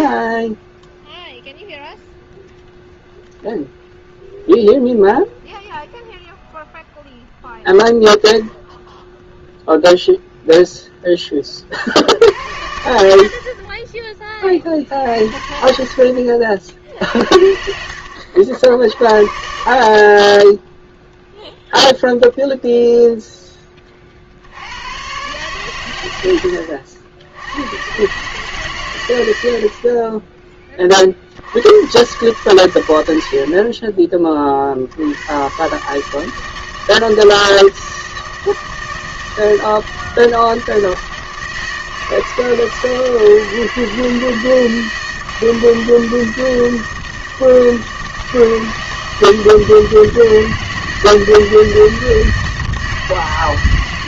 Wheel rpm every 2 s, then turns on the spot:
10, 0, 0, 0, 0, 0, 70, 30, 60, 60, 10, 0, 70, 90, 130, 10, 100, 50, 160, 160, 160, 160, 160, 160, 160, 160, 160.
none